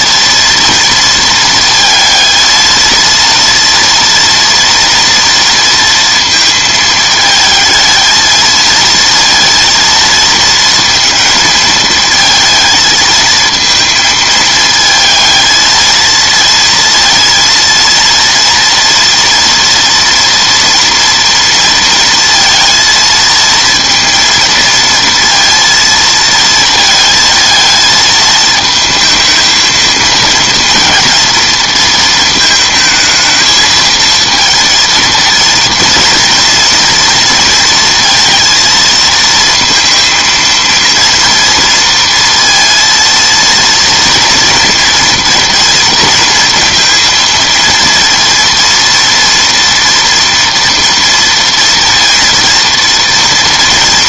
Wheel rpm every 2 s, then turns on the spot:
240, 230, 230, 220, 220, 230, 220, 220, 230, 230, 230, 220, 230, 220, 220, 230, 220, 220, 230, 230, 230, 230, 230, 230, 230, 230, 230.
none